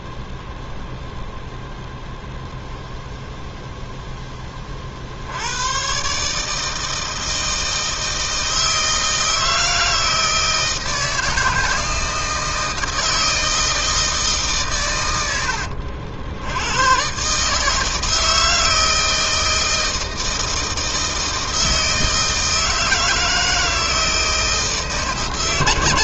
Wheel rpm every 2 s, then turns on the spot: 0, 0, 50, 160, 160, 160, 160, 110, 120, 160, 160, 160, 160.
none